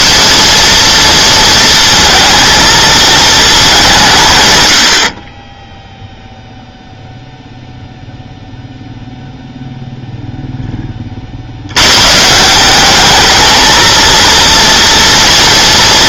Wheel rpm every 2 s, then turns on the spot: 230, 230, 110, 0, 0, 20, 200, 230.
none